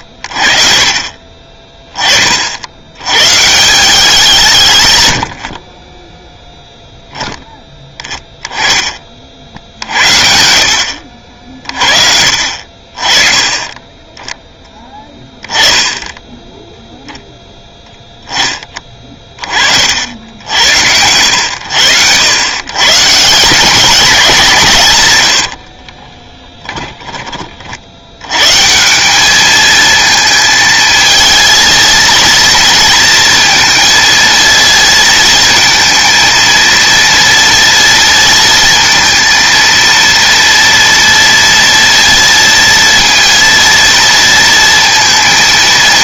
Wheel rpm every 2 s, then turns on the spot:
40, 130, 80, 0, 50, 60, 30, 10, 0, 20, 80, 140, 140, 20, 180, 220, 230, 230, 230, 230, 230, 230, 230.
0-2 26-28